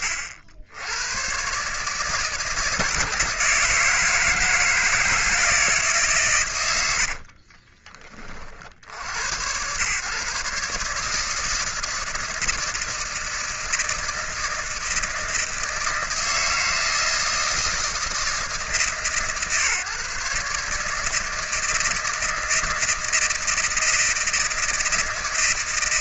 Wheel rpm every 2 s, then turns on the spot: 80, 160, 160, 100, 60, 150, 160, 160, 160, 150, 150, 160, 160.
none